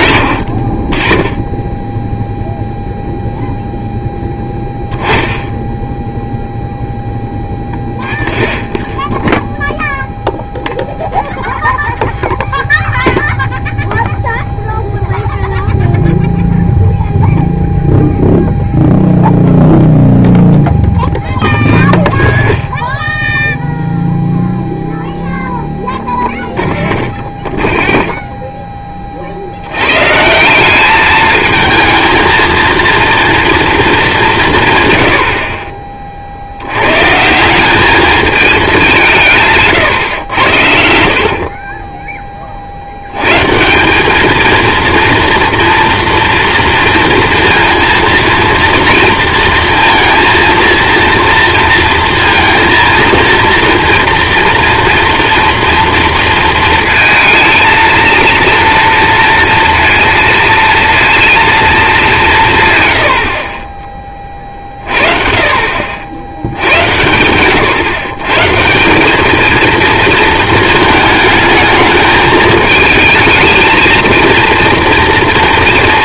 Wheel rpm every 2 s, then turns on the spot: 70, 0, 0, 0, 0, 0, 0, 0, 0, 0, 0, 0, 0, 0, 0, 160, 230, 160, 70, 210, 100, 30, 220, 230, 230, 230, 230, 230, 230, 230, 230, 160, 30, 80, 140, 220, 220, 230.
none